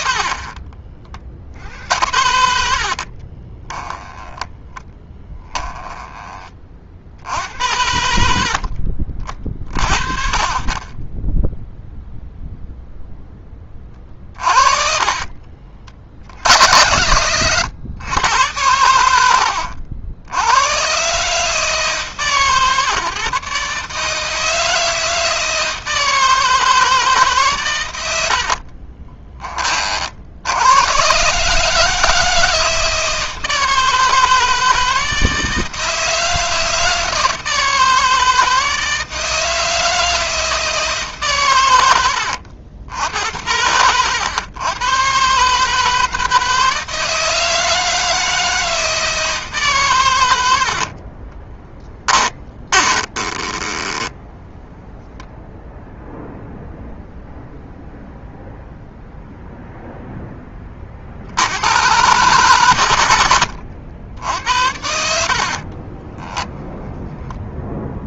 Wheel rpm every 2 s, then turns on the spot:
30, 60, 10, 40, 50, 30, 0, 40, 90, 90, 120, 140, 160, 160, 40, 100, 160, 160, 160, 160, 160, 70, 120, 160, 160, 60, 30, 10, 0, 0, 30, 110, 70, 10.
0-2 4-6 14-16 28-30 50-54 64-66